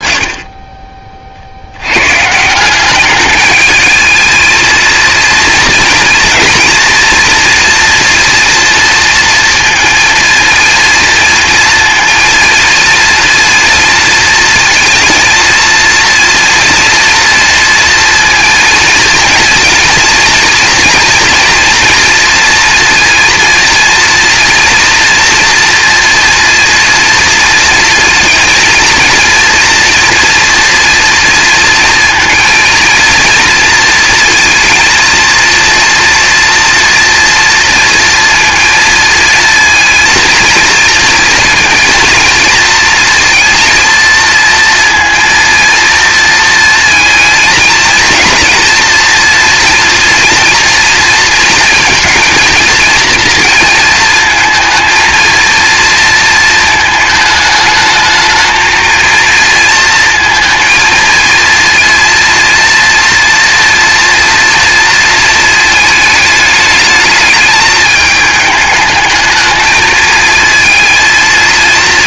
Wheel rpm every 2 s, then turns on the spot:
30, 200, 230, 230, 230, 230, 230, 230, 230, 230, 230, 230, 240, 230, 230, 230, 230, 230, 230, 230, 230, 230, 230, 230, 240, 230, 230, 230, 220, 230, 230, 230, 230, 210, 220, 230.
none